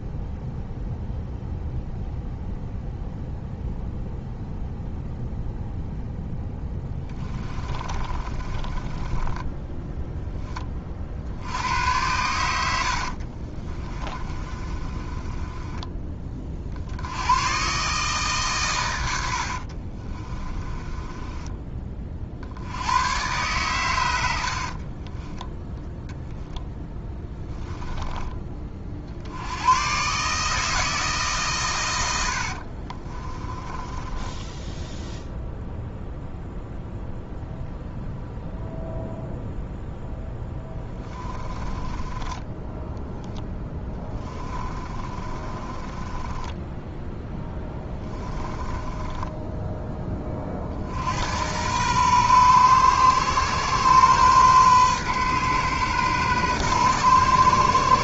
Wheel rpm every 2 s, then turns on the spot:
0, 0, 0, 10, 20, 20, 90, 30, 50, 120, 20, 90, 40, 0, 30, 160, 50, 10, 0, 0, 10, 10, 20, 10, 20, 50, 120, 130, 120.
6-10 12-16 20-22 24-26 32-36 40-50